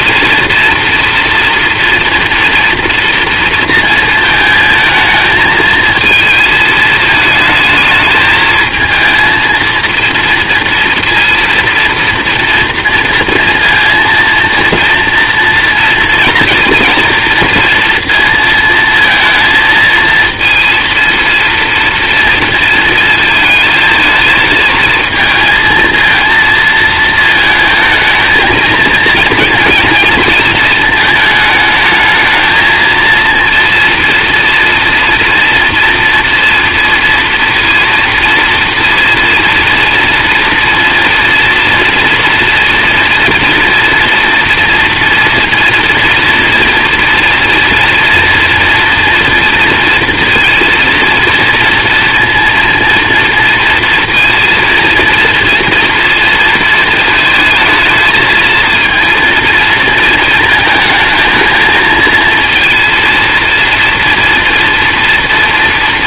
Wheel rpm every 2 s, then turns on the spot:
230, 230, 220, 220, 230, 230, 230, 230, 230, 230, 230, 220, 220, 220, 230, 220, 230, 240, 230, 230, 230, 240, 230, 230, 230, 230, 230, 230, 230, 220, 220, 230, 230.
none